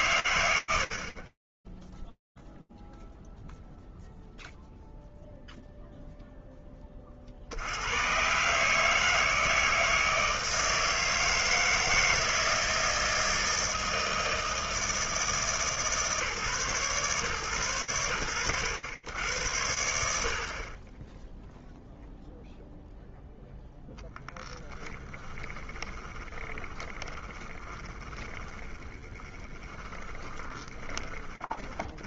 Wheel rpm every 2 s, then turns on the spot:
40, 0, 0, 50, 160, 160, 160, 150, 120, 100, 0, 0, 10, 20, 30, 40.
24-30